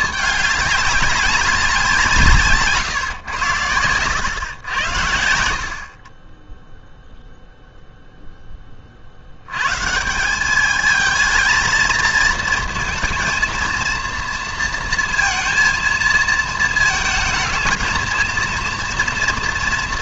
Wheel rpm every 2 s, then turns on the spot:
200, 140, 90, 10, 20, 210, 230, 230, 220, 230.
none